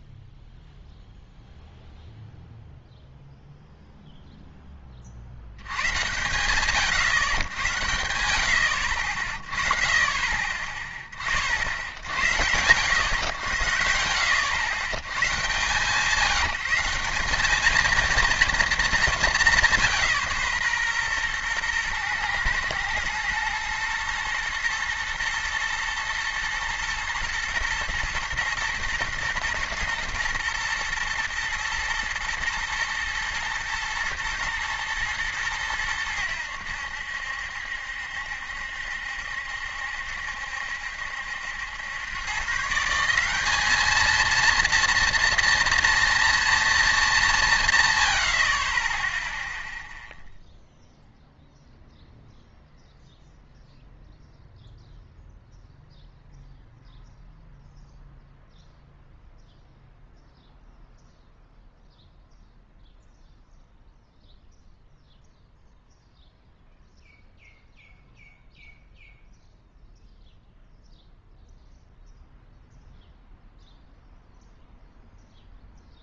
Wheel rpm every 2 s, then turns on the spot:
0, 0, 10, 110, 80, 20, 90, 110, 170, 230, 150, 110, 120, 120, 110, 110, 120, 110, 90, 70, 70, 150, 230, 230, 40, 0, 0, 0, 0, 0, 0, 0, 0, 0, 0, 0, 0, 0.
none